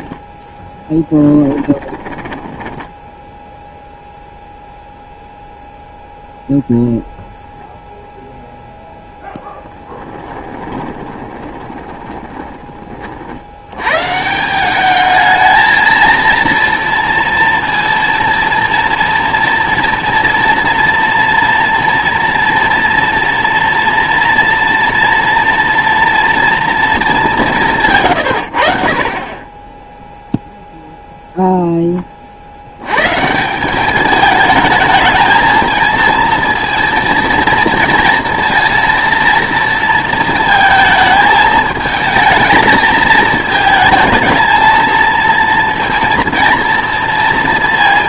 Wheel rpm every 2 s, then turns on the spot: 10, 10, 0, 0, 0, 20, 30, 200, 230, 230, 240, 230, 230, 230, 50, 0, 80, 220, 230, 230, 220, 220, 220, 230.
0-4 10-12